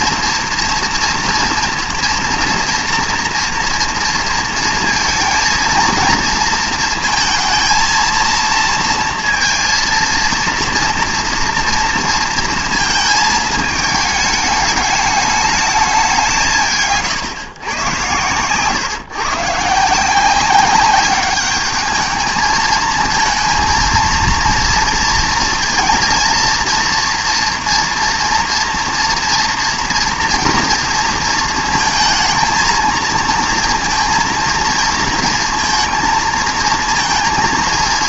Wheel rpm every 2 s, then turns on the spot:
230, 230, 220, 230, 230, 230, 220, 210, 150, 130, 200, 220, 240, 230, 240, 230, 230, 220, 230.
none